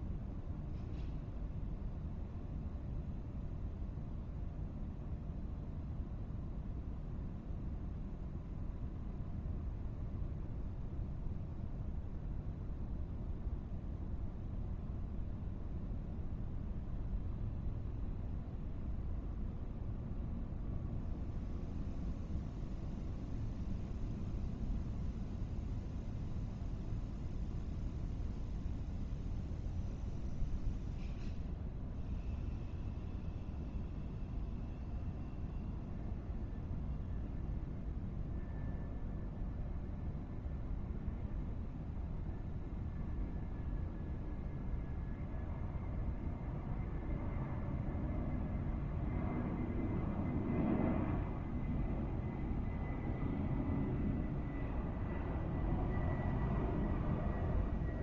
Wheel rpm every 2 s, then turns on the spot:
0, 0, 0, 0, 0, 0, 0, 0, 0, 0, 0, 0, 0, 0, 0, 0, 0, 0, 0, 0, 0, 0, 0, 0, 0, 0, 0, 0, 0.
none